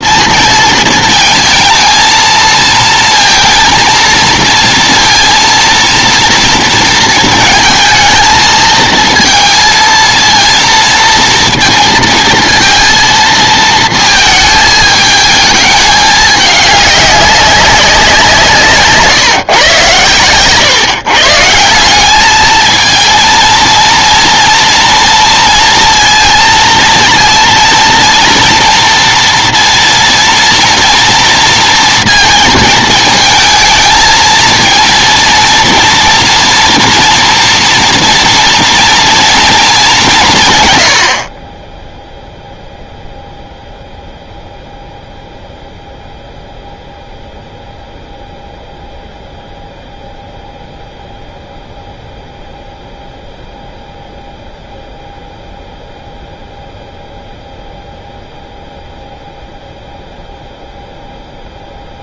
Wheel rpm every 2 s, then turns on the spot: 190, 230, 230, 230, 220, 230, 230, 230, 220, 190, 130, 170, 230, 230, 230, 230, 230, 220, 230, 230, 210, 20, 0, 0, 0, 0, 0, 0, 0, 0, 0.
none